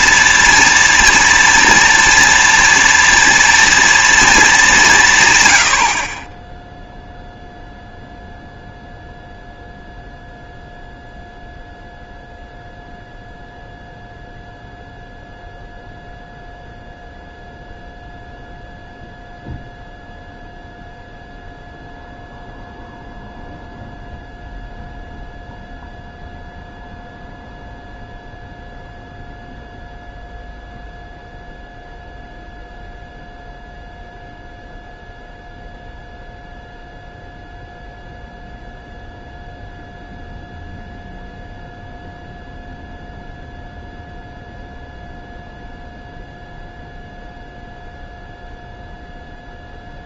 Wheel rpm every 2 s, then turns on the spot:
230, 230, 200, 10, 0, 0, 0, 0, 0, 0, 0, 0, 0, 0, 0, 0, 0, 0, 0, 0, 0, 0, 0, 0, 0.
none